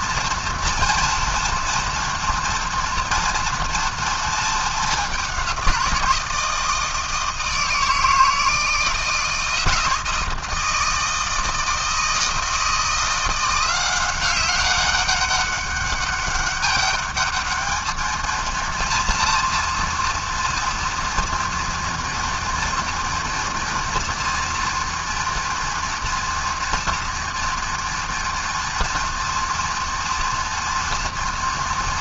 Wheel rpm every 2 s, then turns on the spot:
240, 230, 220, 160, 160, 160, 160, 190, 200, 230, 230, 230, 230, 230, 230, 230.
none